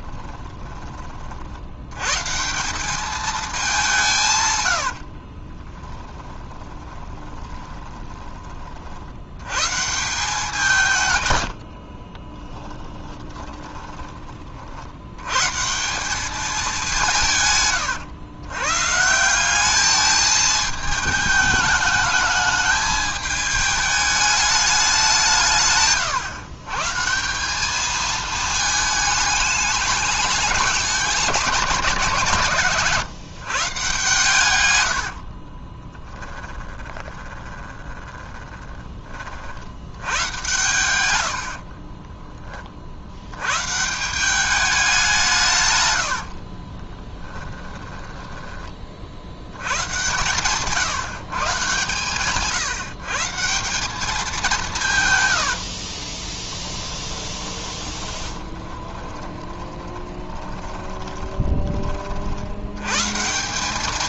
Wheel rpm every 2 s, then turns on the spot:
20, 200, 80, 20, 50, 160, 20, 60, 190, 140, 220, 210, 190, 150, 220, 190, 130, 100, 20, 20, 110, 40, 190, 30, 40, 140, 140, 160, 20, 30, 30, 110.
4-8 12-14 34-38 40-42 46-48 56-62